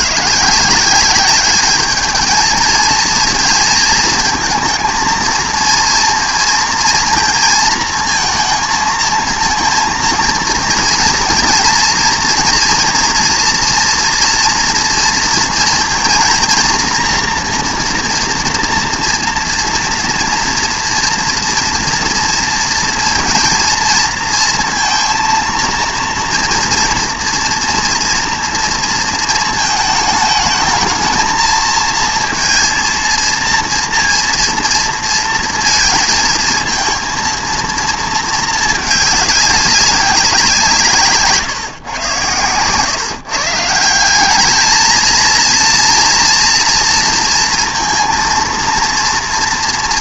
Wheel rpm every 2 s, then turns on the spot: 170, 220, 230, 230, 220, 230, 230, 230, 230, 240, 230, 230, 230, 230, 230, 220, 230, 230, 230, 220, 160, 130, 220, 230, 230.
none